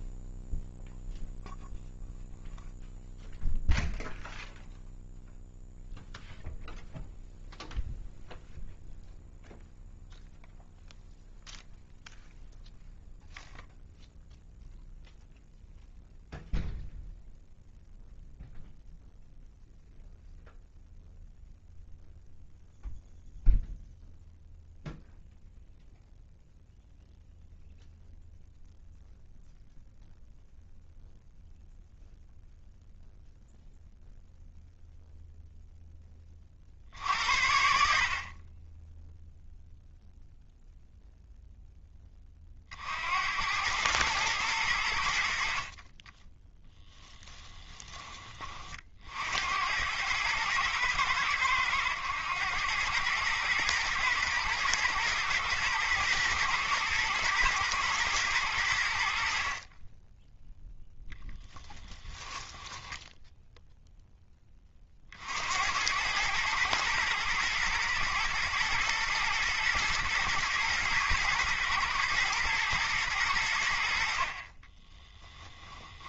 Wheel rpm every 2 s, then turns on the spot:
0, 0, 0, 0, 0, 0, 0, 0, 0, 0, 0, 0, 0, 0, 0, 0, 0, 0, 60, 20, 0, 50, 90, 0, 40, 110, 100, 110, 110, 90, 0, 10, 30, 110, 120, 120, 120, 20.
62-64 74-76